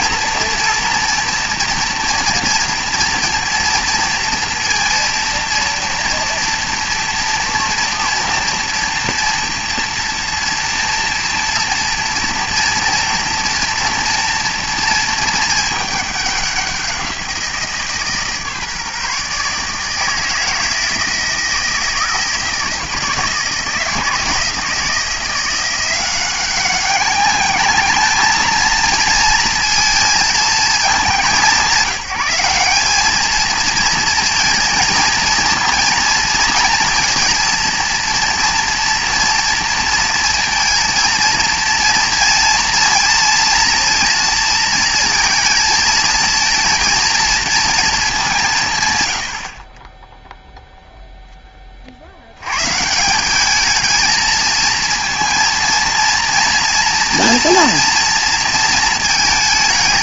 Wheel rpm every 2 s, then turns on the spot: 240, 230, 230, 230, 230, 240, 230, 230, 190, 150, 160, 160, 160, 200, 220, 220, 200, 230, 230, 230, 230, 230, 230, 230, 150, 0, 120, 230, 230, 230.
none